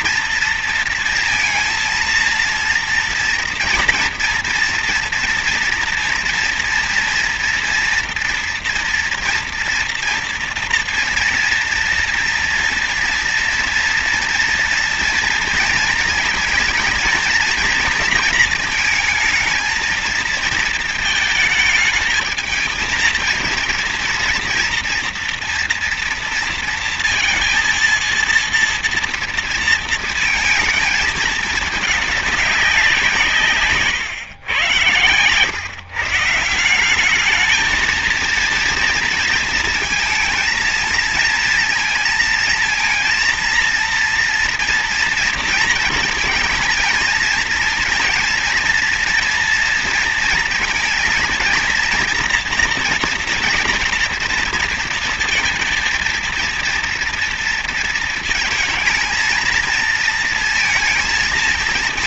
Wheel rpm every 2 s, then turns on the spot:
230, 230, 230, 230, 230, 240, 230, 230, 230, 230, 230, 220, 230, 230, 230, 220, 200, 120, 170, 230, 230, 230, 230, 220, 230, 230, 230, 230, 230, 220, 230.
none